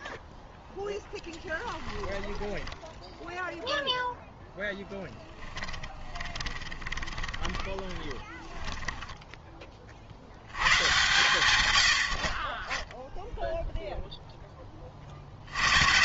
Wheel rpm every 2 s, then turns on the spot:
0, 10, 0, 20, 20, 110, 20, 20.
2-4 6-10